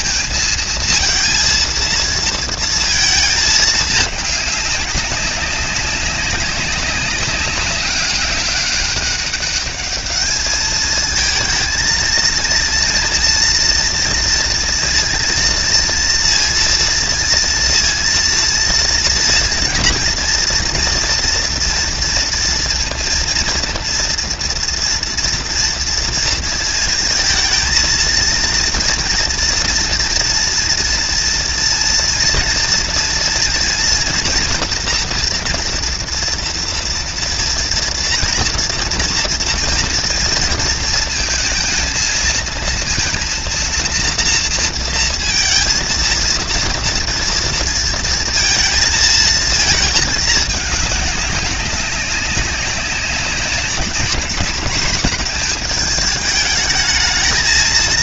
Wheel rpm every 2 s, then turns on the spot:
220, 220, 200, 200, 200, 220, 230, 230, 230, 230, 230, 230, 230, 230, 230, 230, 230, 230, 230, 230, 230, 230, 230, 230, 220, 210, 200, 210, 210.
none